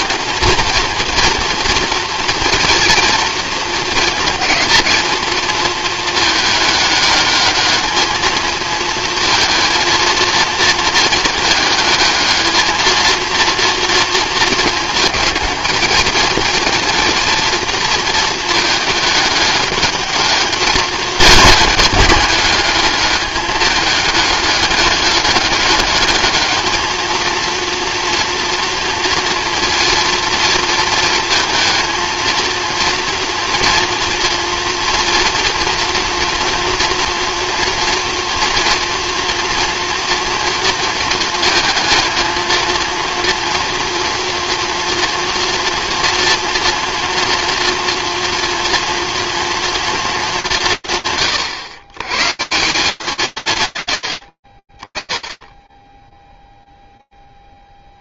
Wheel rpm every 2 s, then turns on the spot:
230, 230, 220, 210, 220, 220, 220, 220, 230, 220, 220, 210, 200, 220, 230, 230, 230, 240, 230, 230, 230, 230, 240, 230, 230, 140, 190, 30, 0.
none